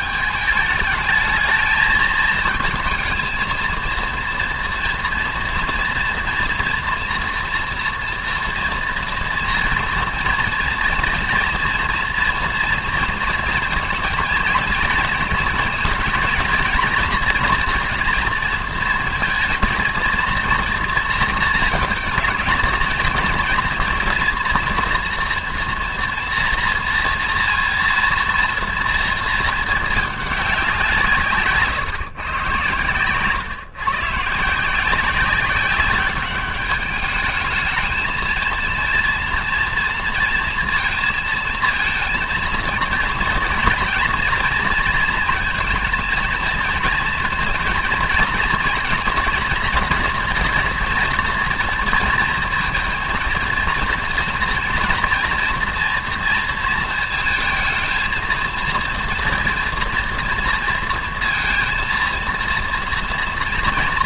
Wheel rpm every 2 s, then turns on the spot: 210, 220, 230, 240, 230, 230, 230, 230, 230, 230, 230, 220, 230, 240, 230, 200, 130, 160, 200, 230, 230, 230, 230, 220, 240, 230, 230, 230, 230, 230, 230, 230.
none